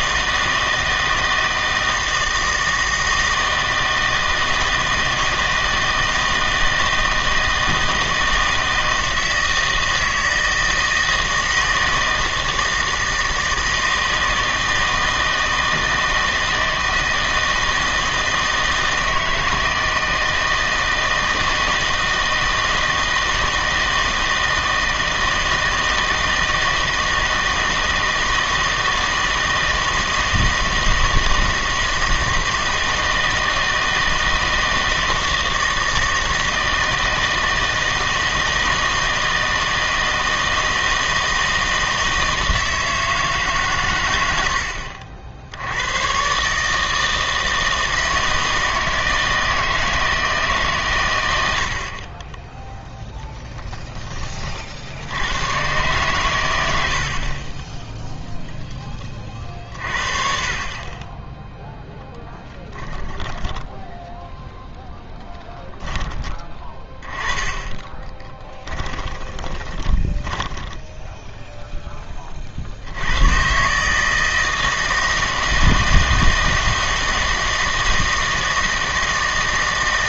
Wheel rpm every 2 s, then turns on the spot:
160, 160, 160, 160, 160, 160, 160, 160, 160, 160, 160, 160, 160, 160, 160, 160, 160, 160, 160, 160, 160, 160, 70, 150, 160, 140, 10, 50, 90, 0, 40, 10, 0, 20, 10, 10, 50, 160, 160, 160.
44-46 60-64 66-72